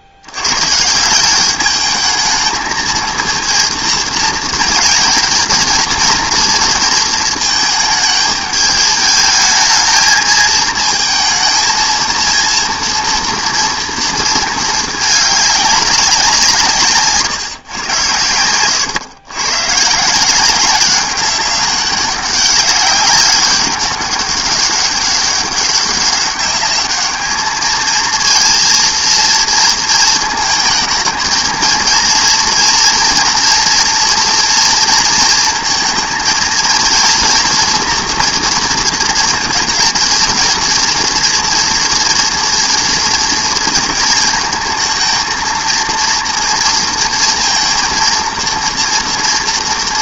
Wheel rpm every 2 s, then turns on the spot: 130, 220, 220, 230, 210, 220, 230, 220, 160, 100, 190, 190, 200, 200, 230, 230, 240, 230, 230, 230, 230, 230, 220, 230, 230.
none